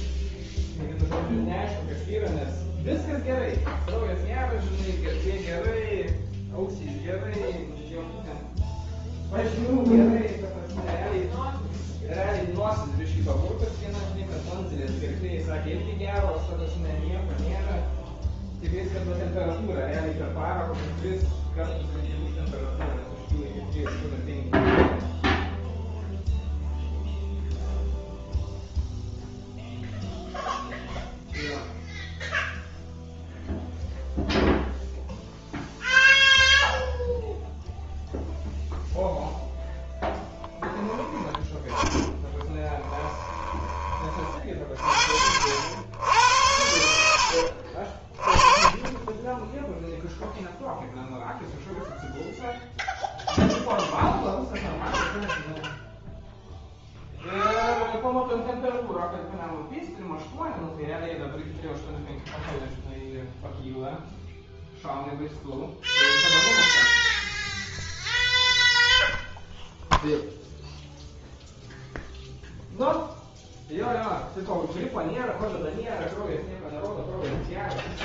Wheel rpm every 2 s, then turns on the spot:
0, 0, 0, 0, 0, 0, 0, 0, 0, 0, 0, 0, 0, 0, 0, 0, 0, 0, 0, 0, 0, 10, 30, 100, 30, 0, 0, 0, 0, 0, 0, 0, 0, 0, 0, 0, 0, 0, 0.
42-44